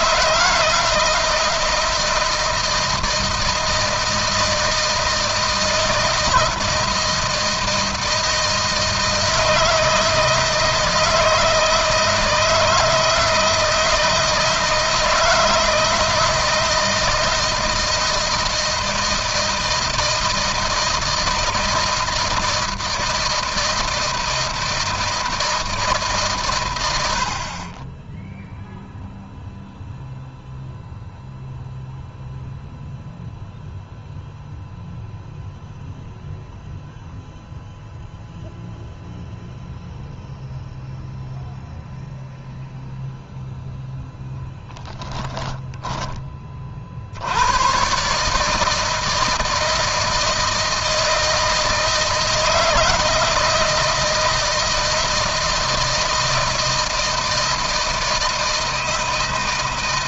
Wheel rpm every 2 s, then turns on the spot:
160, 160, 160, 160, 160, 160, 160, 160, 160, 160, 160, 160, 160, 90, 0, 0, 0, 0, 0, 0, 0, 0, 10, 70, 160, 160, 160, 160, 160, 160.
44-46